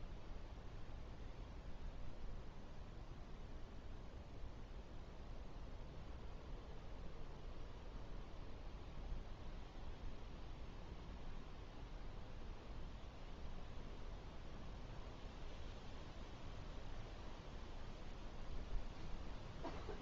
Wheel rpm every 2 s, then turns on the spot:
0, 0, 0, 0, 0, 0, 0, 0, 0, 0.
none